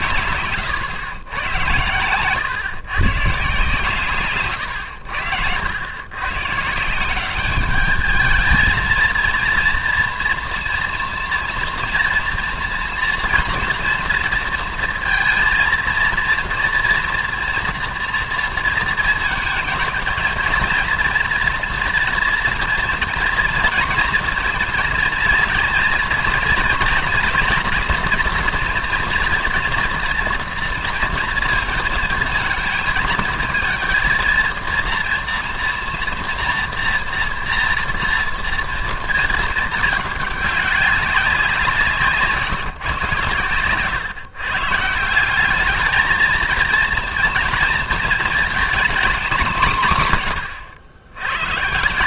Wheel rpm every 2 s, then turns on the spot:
120, 130, 120, 140, 220, 230, 230, 230, 230, 230, 220, 240, 230, 230, 240, 230, 220, 230, 230, 230, 200, 140, 140, 230, 240, 100.
4-6